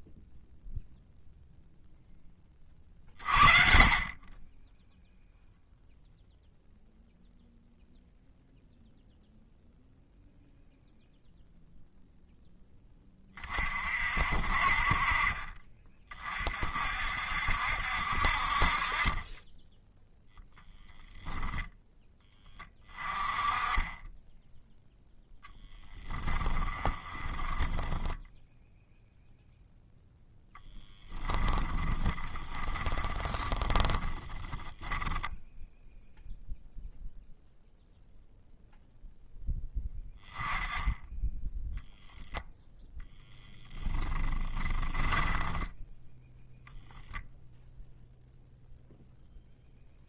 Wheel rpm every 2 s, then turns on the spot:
0, 30, 10, 0, 0, 0, 10, 40, 50, 50, 0, 20, 0, 20, 0, 0, 20, 10, 0, 0, 10, 0, 10, 0, 0.
26-28 32-36 44-46